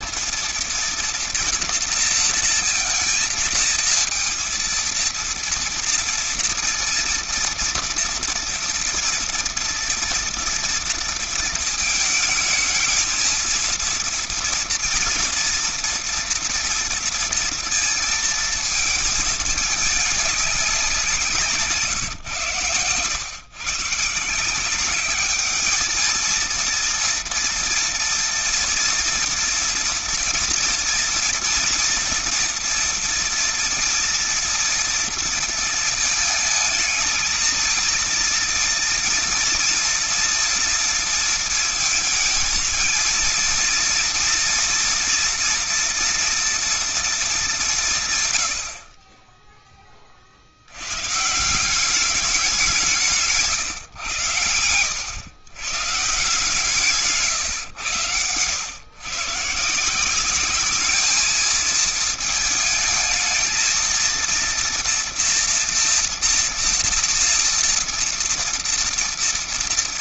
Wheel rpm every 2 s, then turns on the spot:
230, 230, 230, 230, 230, 230, 220, 220, 230, 230, 200, 120, 170, 230, 230, 230, 230, 230, 220, 230, 230, 220, 230, 240, 100, 70, 200, 100, 150, 100, 200, 220, 230, 230, 230.
none